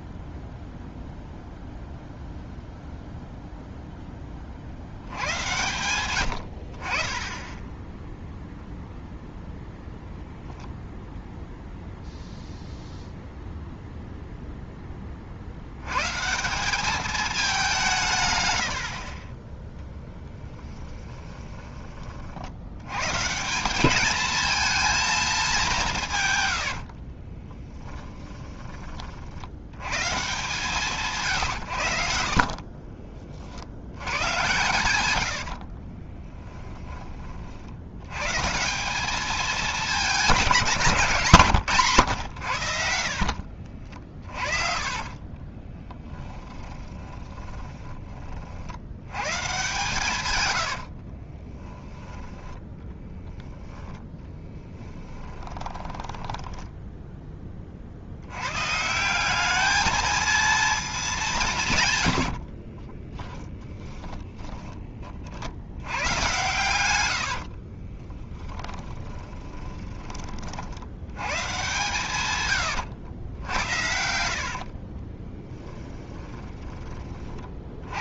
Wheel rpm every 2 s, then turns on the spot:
0, 0, 60, 50, 0, 0, 0, 10, 200, 80, 20, 90, 230, 80, 20, 160, 40, 100, 30, 180, 180, 70, 40, 20, 70, 80, 10, 10, 10, 140, 220, 40, 30, 100, 20, 70, 100, 40, 20.
18-22 26-28 32-34 36-38 44-48 50-52 54-58 62-64 68-70 72-76